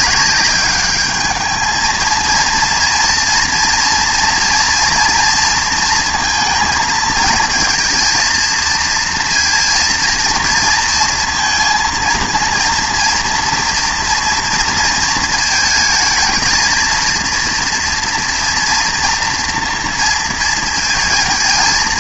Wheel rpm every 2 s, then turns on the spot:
210, 230, 230, 220, 230, 230, 230, 230, 220, 230, 230.
none